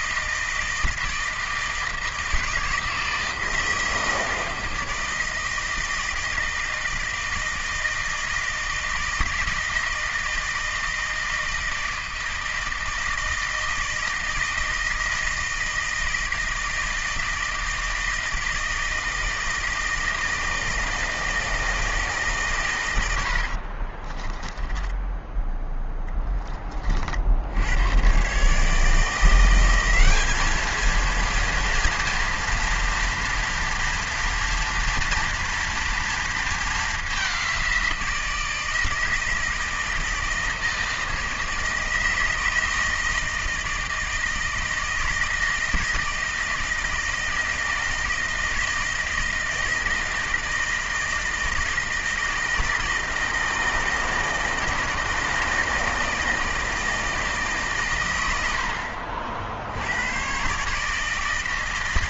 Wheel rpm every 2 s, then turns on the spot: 160, 160, 160, 160, 160, 160, 160, 160, 160, 160, 160, 130, 10, 30, 140, 210, 240, 230, 220, 170, 160, 160, 160, 160, 160, 160, 160, 160, 160, 70, 140.
24-26